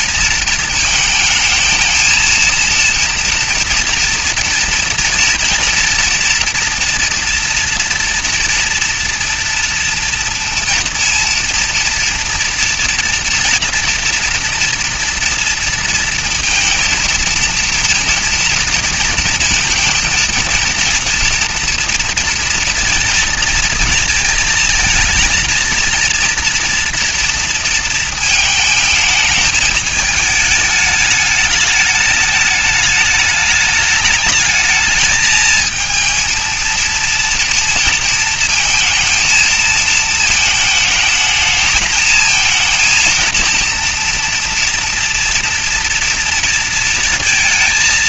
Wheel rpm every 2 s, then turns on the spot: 220, 230, 230, 230, 230, 230, 230, 230, 230, 230, 230, 230, 220, 230, 220, 210, 210, 220, 230, 220, 220, 230, 230, 230.
none